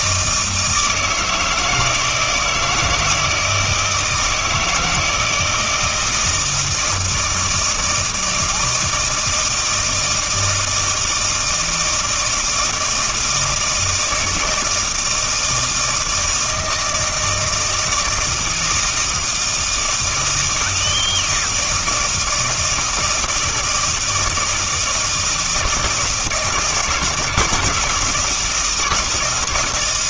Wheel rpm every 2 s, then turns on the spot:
160, 160, 160, 160, 160, 160, 160, 160, 160, 160, 160, 160, 170, 160, 160.
none